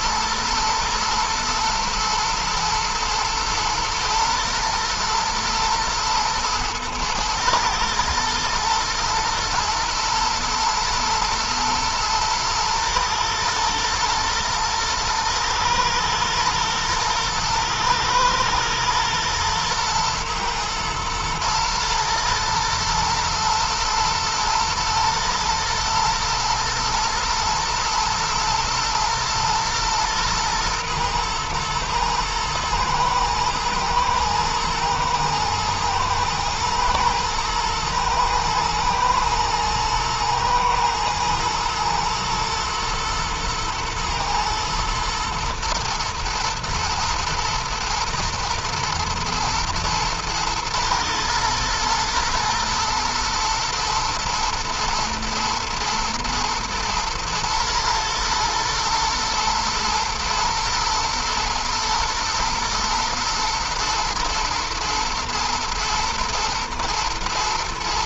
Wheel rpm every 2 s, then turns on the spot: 110, 110, 120, 110, 120, 110, 110, 110, 120, 110, 120, 110, 110, 110, 120, 120, 110, 110, 110, 120, 110, 110, 110, 120, 110, 110, 110, 120, 120, 120, 110, 110, 120, 110.
none